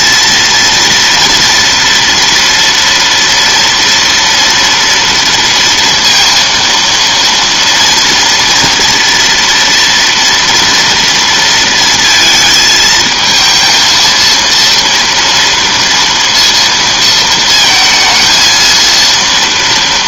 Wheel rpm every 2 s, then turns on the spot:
230, 230, 230, 230, 230, 230, 220, 230, 230, 230.
none